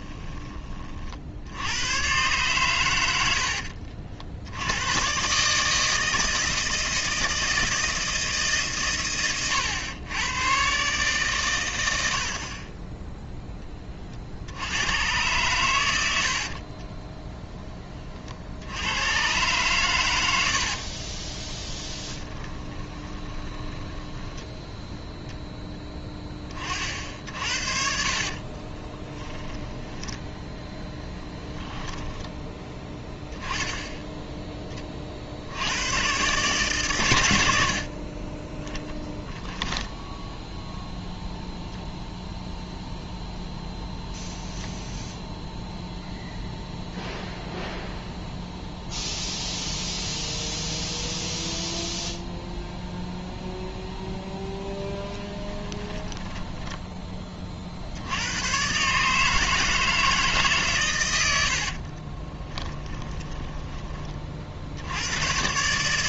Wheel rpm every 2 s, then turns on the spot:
30, 110, 90, 160, 140, 130, 20, 90, 30, 80, 50, 20, 10, 50, 30, 10, 10, 20, 130, 10, 0, 0, 0, 0, 0, 0, 0, 10, 20, 140, 110, 20, 60.
16-18 22-24 28-30 38-40 62-64